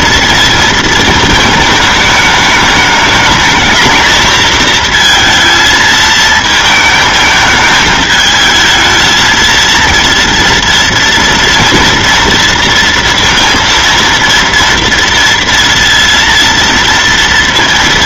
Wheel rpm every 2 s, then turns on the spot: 230, 210, 230, 220, 220, 230, 230, 230, 230.
none